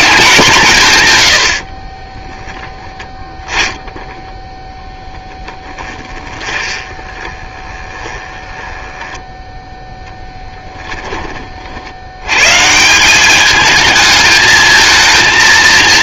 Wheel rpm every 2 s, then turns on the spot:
160, 20, 0, 20, 10, 10, 160, 230.
2-4 6-10